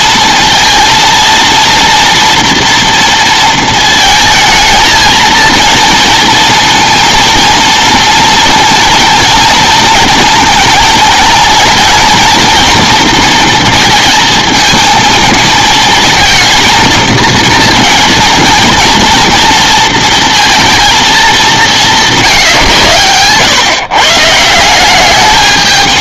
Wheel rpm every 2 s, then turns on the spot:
230, 230, 220, 230, 230, 230, 240, 220, 220, 230, 230, 140, 170.
none